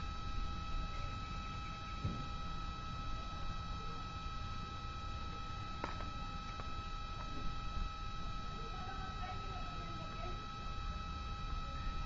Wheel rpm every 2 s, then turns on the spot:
0, 0, 0, 0, 0, 0.
none